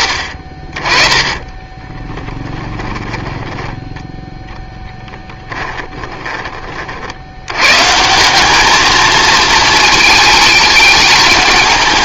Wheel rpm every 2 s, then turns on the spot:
40, 20, 10, 40, 220, 210.
2-4